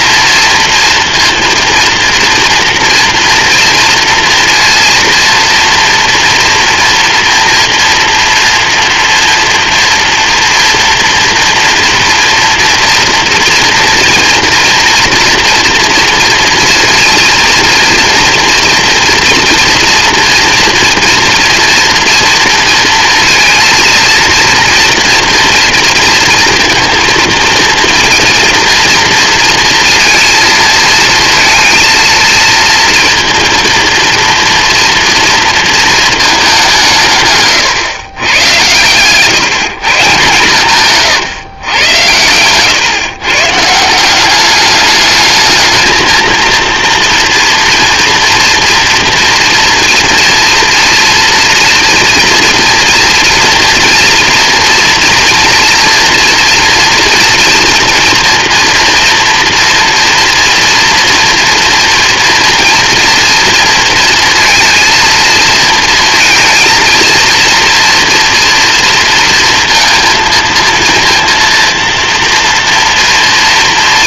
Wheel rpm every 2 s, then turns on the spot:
230, 230, 230, 230, 230, 230, 230, 230, 230, 230, 230, 230, 230, 230, 230, 220, 230, 230, 150, 130, 140, 130, 210, 240, 230, 230, 230, 230, 230, 230, 230, 230, 230, 230, 230, 230, 230.
none